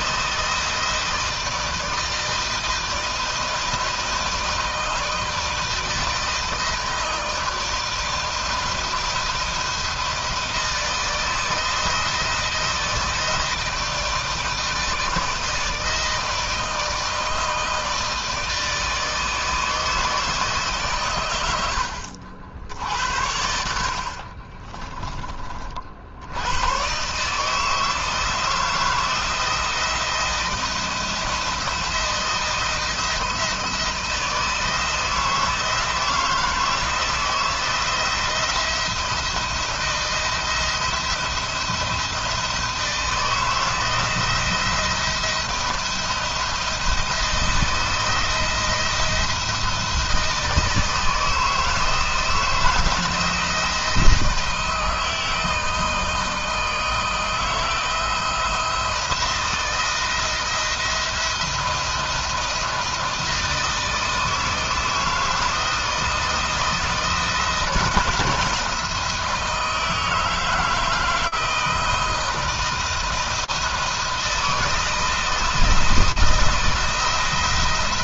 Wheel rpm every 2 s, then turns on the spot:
160, 160, 160, 160, 160, 160, 160, 160, 160, 160, 120, 70, 30, 130, 170, 170, 160, 160, 160, 160, 170, 160, 170, 160, 170, 160, 170, 160, 160, 170, 170, 160, 160, 160, 170, 160, 160, 160, 170.
none